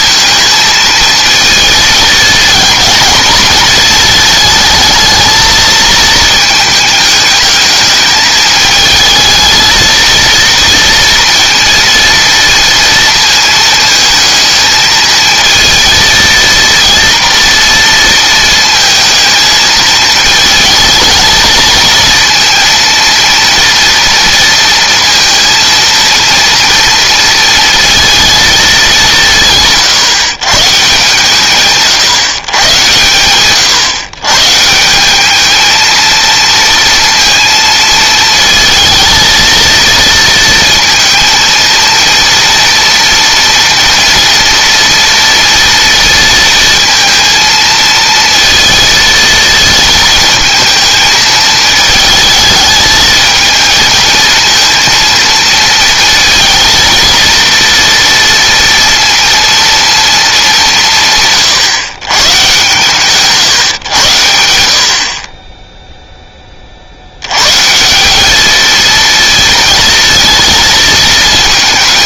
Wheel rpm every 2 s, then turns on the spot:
230, 230, 220, 210, 220, 230, 230, 220, 230, 220, 220, 230, 230, 230, 200, 140, 120, 170, 230, 220, 230, 230, 230, 230, 230, 220, 220, 230, 230, 230, 180, 140, 70, 60, 220, 220.
none